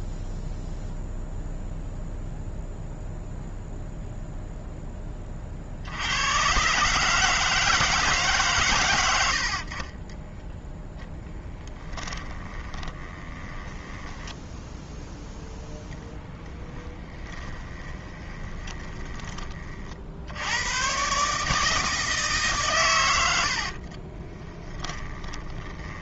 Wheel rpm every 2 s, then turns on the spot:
0, 0, 10, 130, 120, 0, 20, 0, 10, 30, 110, 130, 20.
12-14 16-20 24-26